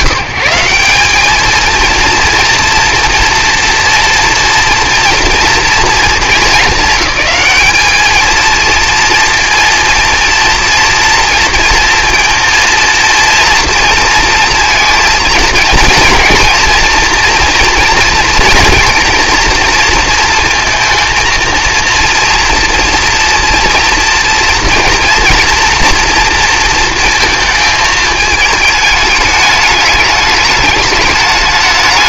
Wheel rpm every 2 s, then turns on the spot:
190, 230, 230, 210, 230, 230, 230, 230, 230, 230, 230, 230, 230, 230, 210, 210.
none